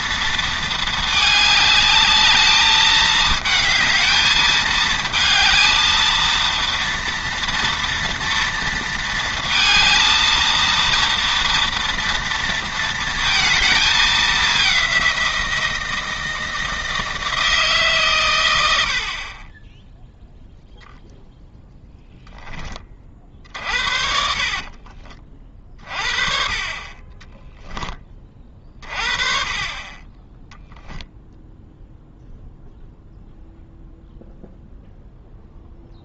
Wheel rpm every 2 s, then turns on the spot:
220, 210, 220, 230, 230, 230, 230, 200, 160, 80, 0, 20, 40, 30, 40, 0, 0, 0.
24-26